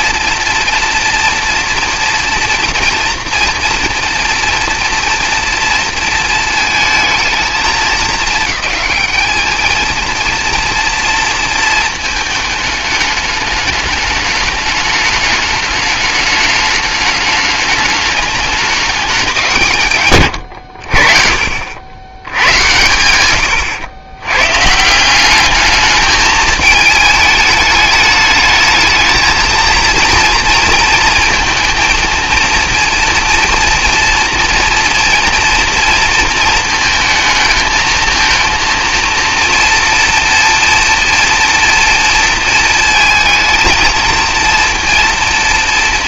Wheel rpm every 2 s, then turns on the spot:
230, 240, 230, 220, 210, 230, 210, 210, 210, 210, 70, 100, 150, 210, 220, 230, 230, 230, 220, 230, 230, 230, 230.
none